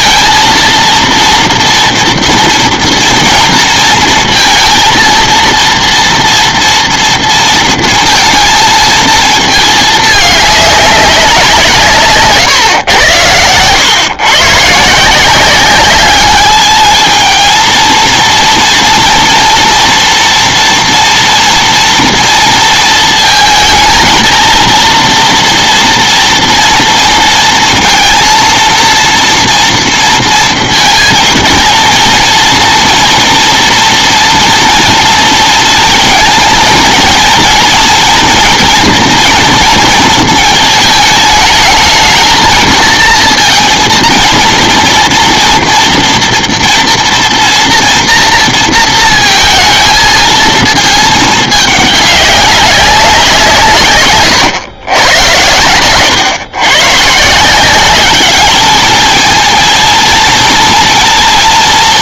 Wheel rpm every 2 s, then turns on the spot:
230, 230, 230, 230, 230, 210, 140, 140, 220, 240, 240, 230, 230, 230, 230, 230, 230, 240, 230, 230, 220, 230, 230, 230, 230, 220, 200, 120, 120, 210, 230.
none